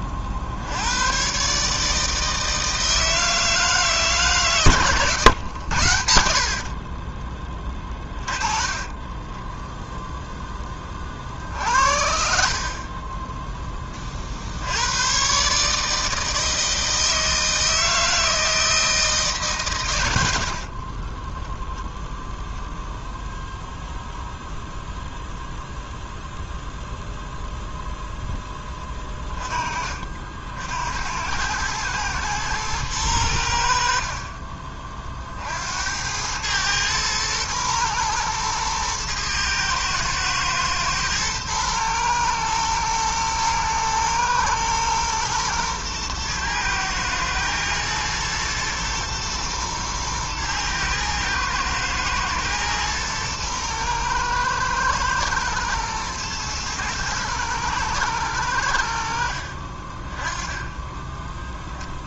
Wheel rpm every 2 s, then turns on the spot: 50, 160, 140, 60, 30, 10, 50, 70, 160, 160, 70, 0, 0, 0, 10, 70, 110, 30, 100, 120, 110, 110, 110, 110, 110, 110, 110, 110, 110, 100, 20.
8-10 20-22